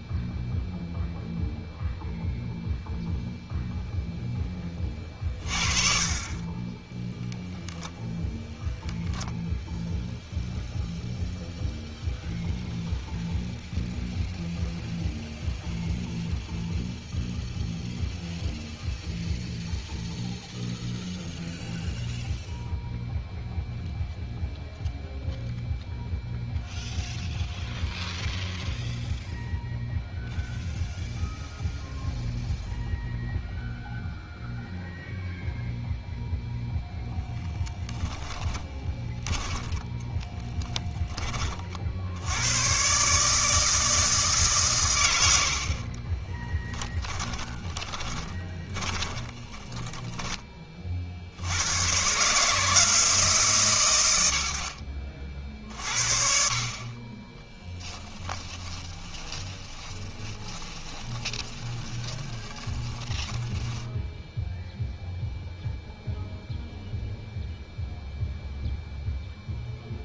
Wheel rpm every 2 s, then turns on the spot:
0, 0, 20, 10, 0, 0, 0, 0, 0, 0, 0, 0, 0, 0, 0, 0, 0, 0, 0, 10, 10, 120, 140, 20, 20, 30, 160, 70, 40, 20, 20, 20, 0, 0, 0.
38-40 46-50 58-64